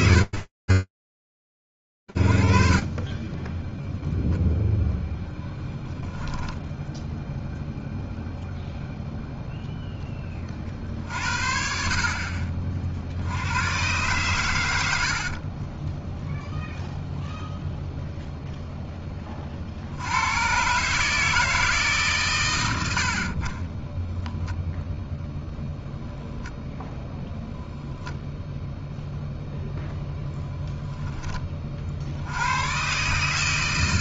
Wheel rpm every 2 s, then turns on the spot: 0, 0, 0, 0, 50, 80, 40, 0, 0, 120, 110, 0, 0, 0, 20, 80, 160.
12-14